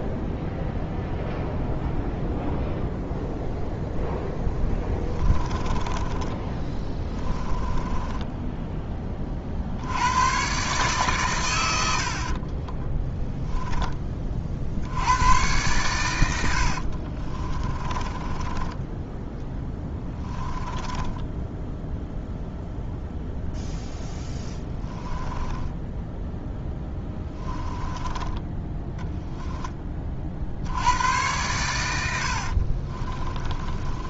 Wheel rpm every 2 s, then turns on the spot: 0, 0, 10, 10, 10, 130, 10, 70, 60, 10, 10, 0, 10, 10, 10, 90, 40.
4-8 12-14 16-22 24-28 32-34